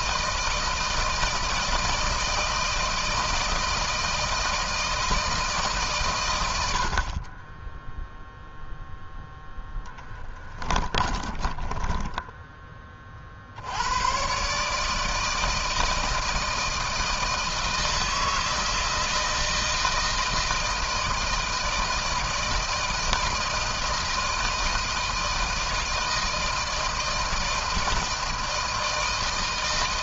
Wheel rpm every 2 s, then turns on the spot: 160, 160, 160, 80, 0, 20, 20, 140, 160, 160, 160, 160, 160, 160, 160.
10-12